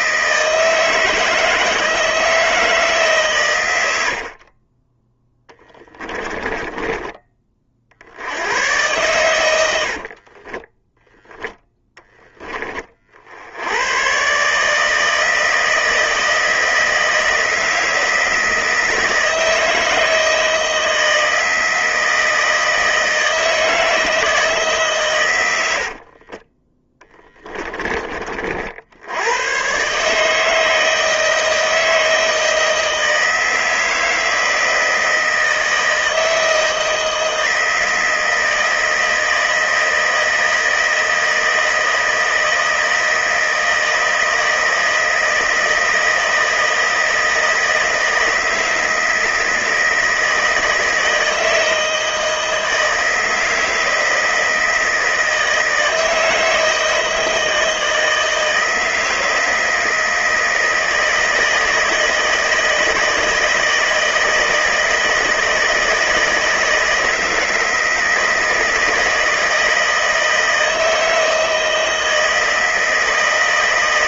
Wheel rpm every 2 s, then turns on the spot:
160, 150, 20, 20, 110, 10, 30, 150, 160, 160, 160, 160, 140, 20, 80, 160, 160, 160, 160, 160, 160, 160, 160, 160, 160, 160, 160, 160, 160, 160, 160, 160, 160, 160, 160, 160, 160.
6-8 10-12 26-28